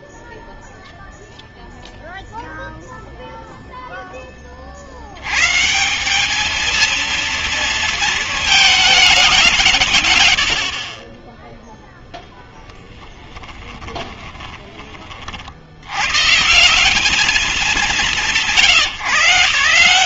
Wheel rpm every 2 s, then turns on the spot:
0, 0, 40, 220, 220, 70, 10, 30, 180, 140.
10-14